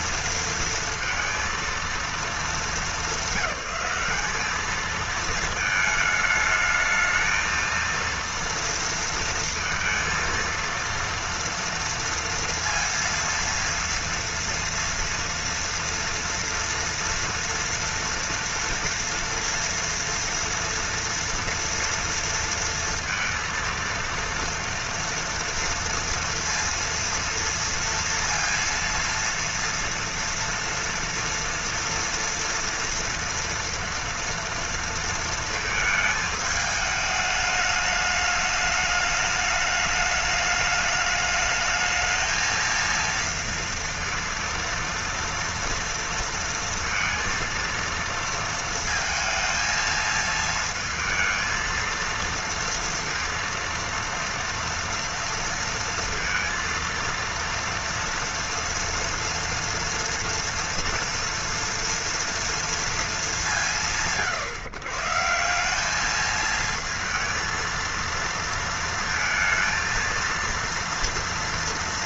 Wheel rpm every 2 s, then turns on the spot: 230, 200, 220, 220, 230, 230, 230, 230, 230, 230, 230, 230, 230, 230, 230, 230, 230, 230, 210, 210, 210, 230, 230, 230, 220, 220, 230, 230, 230, 230, 230, 230, 140, 220, 230, 230.
none